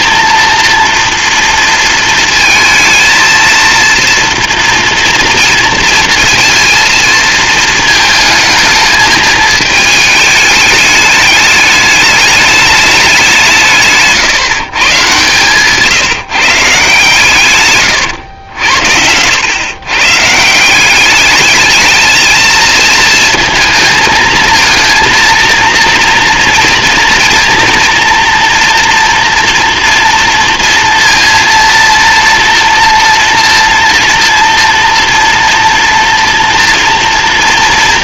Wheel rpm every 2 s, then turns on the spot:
240, 230, 230, 230, 220, 210, 210, 150, 150, 80, 170, 220, 230, 230, 240, 230, 230, 240, 240.
none